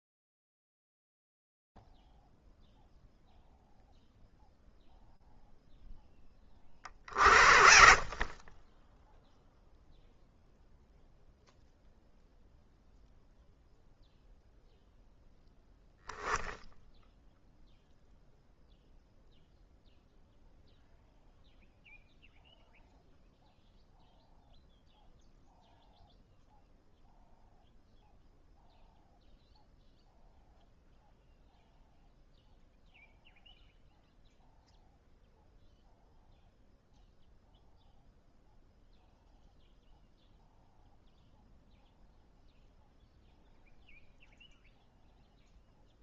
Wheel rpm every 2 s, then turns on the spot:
0, 0, 0, 30, 20, 0, 0, 0, 0, 0, 0, 0, 0, 0, 0, 0, 0, 0, 0, 0, 0, 0, 0.
none